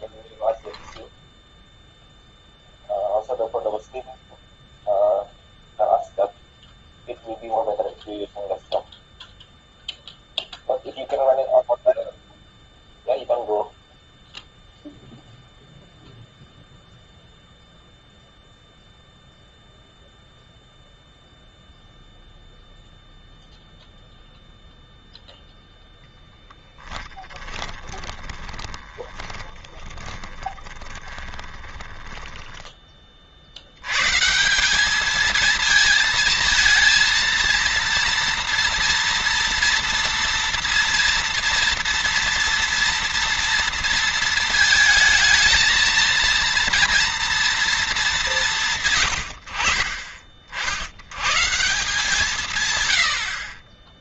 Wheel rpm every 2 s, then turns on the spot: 0, 0, 0, 0, 0, 0, 0, 0, 0, 0, 0, 0, 0, 20, 20, 20, 20, 170, 220, 230, 230, 240, 230, 230, 160, 50, 140.
28-34